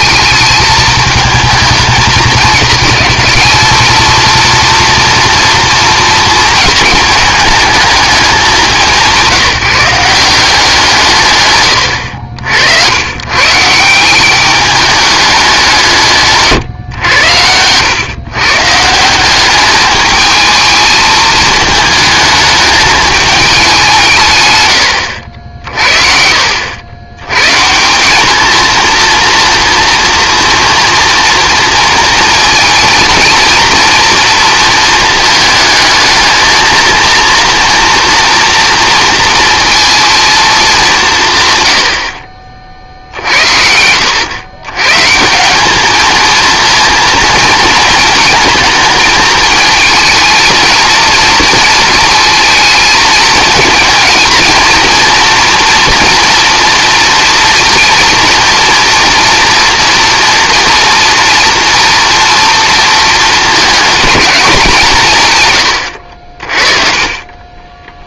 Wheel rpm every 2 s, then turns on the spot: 220, 210, 230, 220, 200, 180, 80, 210, 120, 150, 220, 210, 110, 80, 220, 230, 230, 230, 220, 230, 220, 40, 120, 230, 220, 230, 220, 220, 230, 230, 230, 230, 190, 40.
none